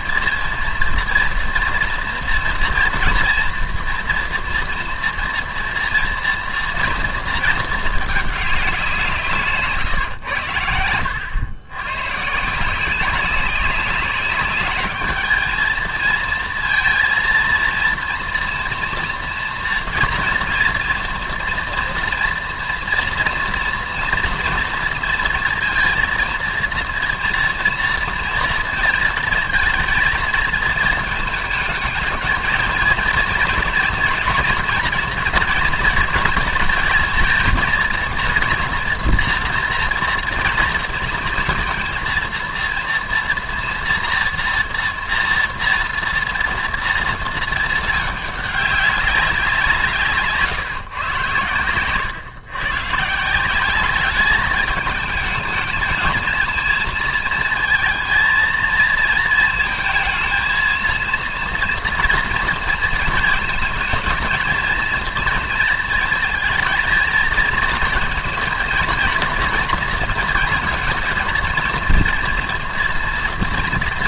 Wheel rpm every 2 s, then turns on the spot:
230, 230, 240, 230, 190, 90, 160, 200, 230, 230, 230, 230, 230, 230, 230, 230, 230, 240, 220, 230, 230, 230, 230, 230, 210, 150, 120, 210, 230, 230, 230, 230, 230, 220, 230, 230, 230.
none